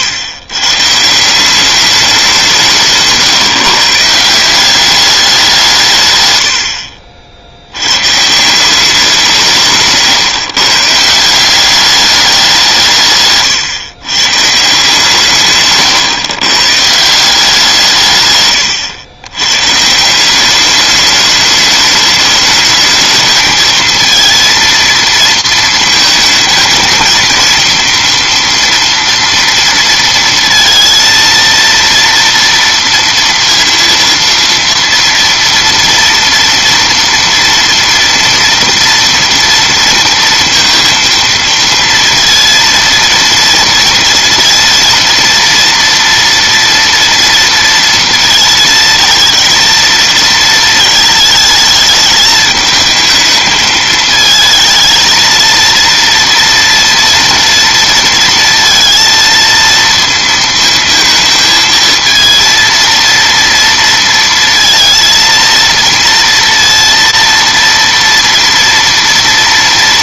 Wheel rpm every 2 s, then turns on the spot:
130, 160, 190, 90, 180, 140, 170, 150, 130, 120, 200, 210, 230, 220, 230, 230, 230, 230, 240, 230, 230, 230, 230, 230, 230, 220, 220, 220, 230, 230, 220, 230, 230, 230, 230.
none